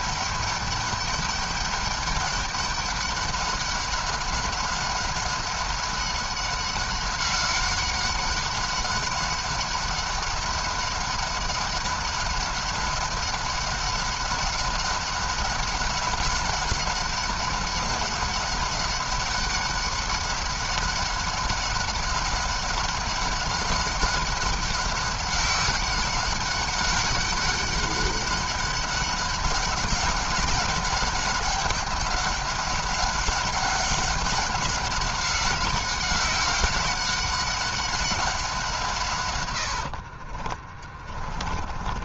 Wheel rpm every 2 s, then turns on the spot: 200, 200, 190, 190, 190, 190, 190, 190, 190, 200, 200, 190, 190, 190, 200, 190, 200, 200, 190, 180, 50.
40-42